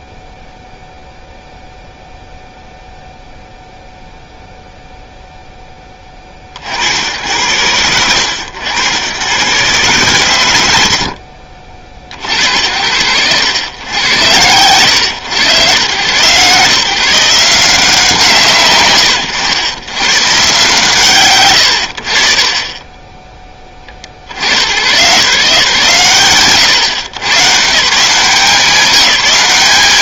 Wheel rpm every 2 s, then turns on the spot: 0, 0, 0, 70, 100, 80, 80, 120, 150, 110, 130, 20, 120, 120, 200.
none